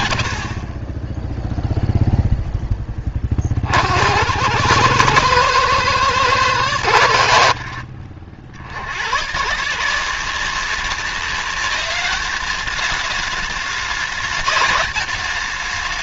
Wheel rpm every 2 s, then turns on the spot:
40, 10, 90, 100, 90, 190, 210, 210.
none